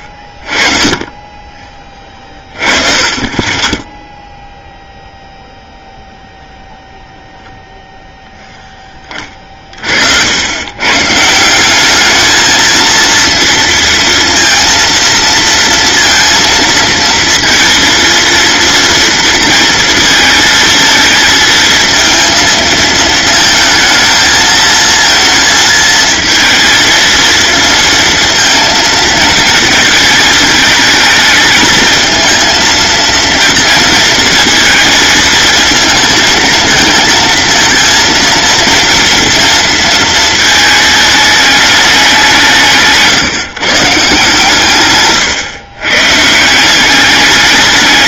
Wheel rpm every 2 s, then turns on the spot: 20, 30, 0, 0, 10, 120, 230, 230, 230, 230, 220, 220, 230, 230, 230, 220, 230, 230, 220, 230, 220, 160, 130, 190.
none